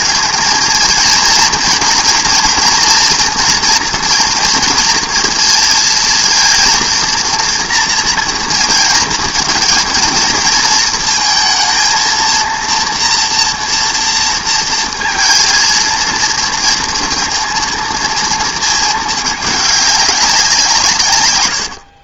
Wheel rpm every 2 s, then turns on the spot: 230, 240, 230, 230, 230, 230, 230, 230, 230, 230, 180.
none